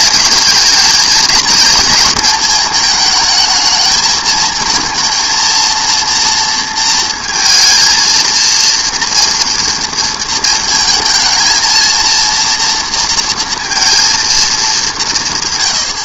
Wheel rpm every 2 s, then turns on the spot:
220, 220, 230, 230, 230, 220, 230, 220.
none